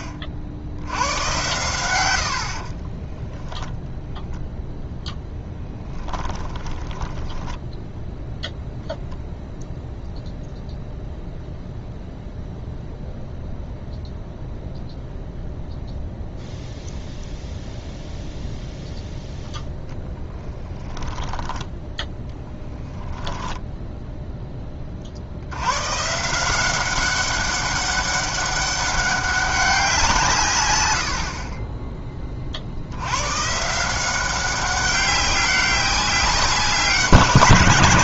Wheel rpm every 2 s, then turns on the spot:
80, 40, 0, 10, 0, 0, 0, 0, 0, 0, 10, 10, 20, 180, 200, 110, 70, 190, 190.
2-4 6-8 20-22